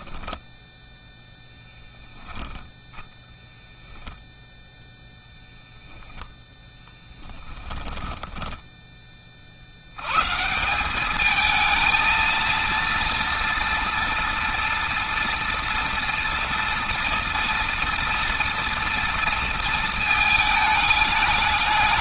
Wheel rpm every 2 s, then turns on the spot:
10, 0, 0, 10, 10, 180, 230, 230, 230, 240, 220.
0-2